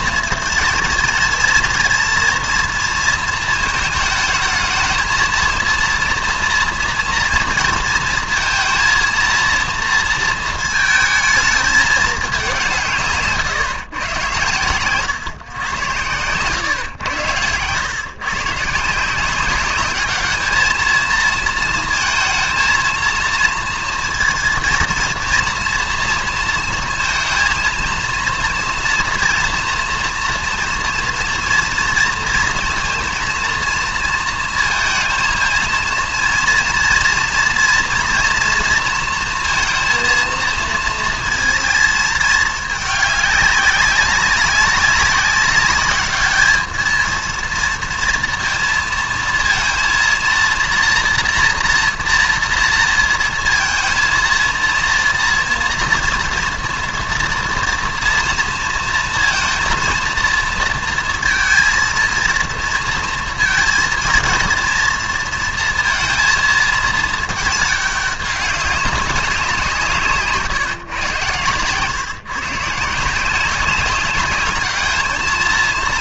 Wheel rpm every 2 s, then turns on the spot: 230, 230, 220, 230, 230, 220, 180, 120, 110, 140, 220, 230, 230, 230, 230, 240, 230, 230, 230, 230, 230, 220, 200, 210, 230, 230, 230, 230, 230, 230, 230, 230, 230, 220, 200, 150, 150, 210.
none